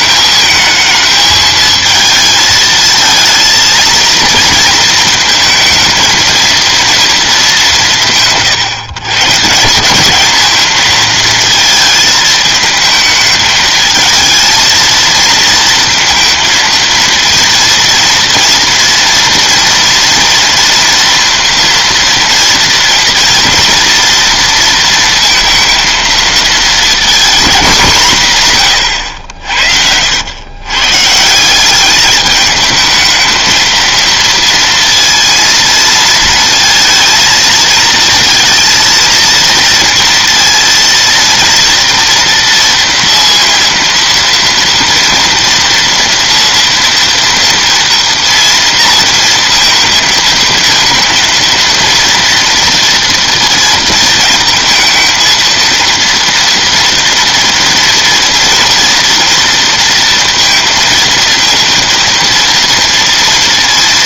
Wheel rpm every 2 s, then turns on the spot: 220, 220, 230, 230, 140, 230, 220, 230, 230, 230, 230, 230, 230, 230, 120, 130, 220, 230, 220, 230, 230, 230, 230, 230, 230, 230, 230, 220, 230, 230, 230, 230.
none